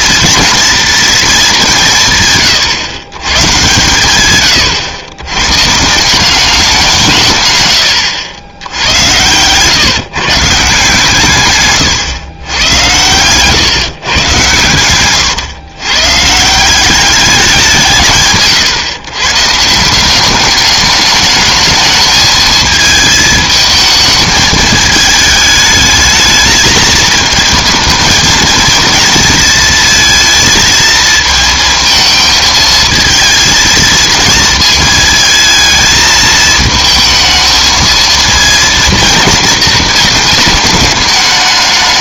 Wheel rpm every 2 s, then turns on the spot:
230, 130, 110, 190, 90, 160, 110, 110, 180, 130, 200, 220, 220, 220, 230, 230, 220, 230, 220, 230, 210.
8-10 12-14